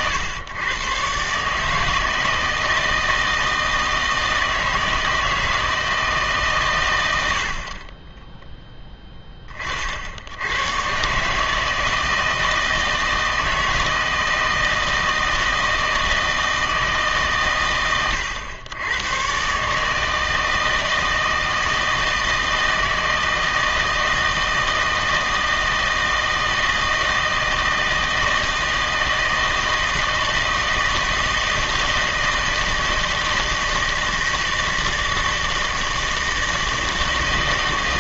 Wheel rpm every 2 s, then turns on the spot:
120, 160, 160, 130, 10, 110, 160, 160, 160, 100, 160, 160, 160, 160, 160, 160, 160, 160, 160.
none